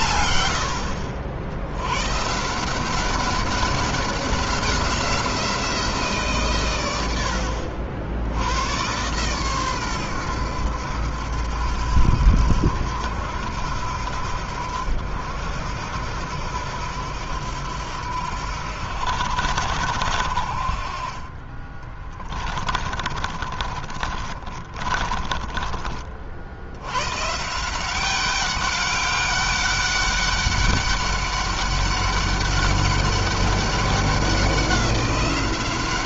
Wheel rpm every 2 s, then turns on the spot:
80, 170, 180, 130, 100, 90, 80, 70, 80, 80, 60, 30, 30, 100, 200, 200, 200, 190.
22-26